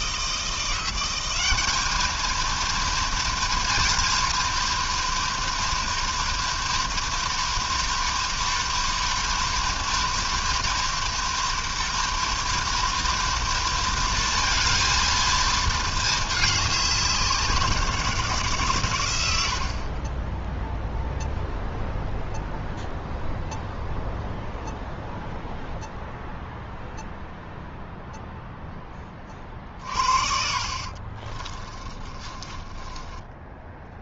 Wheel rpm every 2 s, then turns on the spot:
170, 230, 230, 240, 230, 240, 230, 230, 210, 150, 10, 0, 0, 0, 0, 50, 30.
30-34